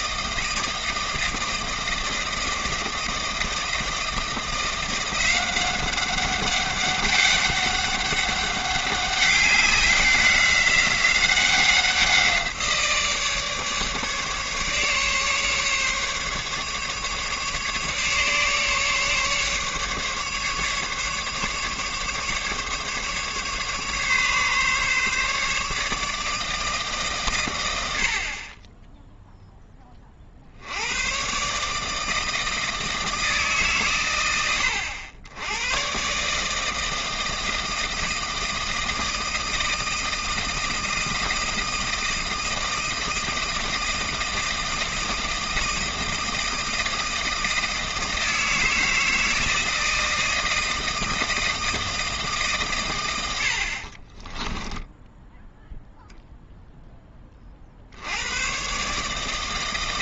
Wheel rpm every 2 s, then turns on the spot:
160, 160, 170, 200, 200, 190, 170, 150, 140, 150, 150, 150, 140, 150, 20, 80, 160, 90, 160, 170, 160, 160, 160, 170, 160, 160, 140, 10, 0, 120.
54-56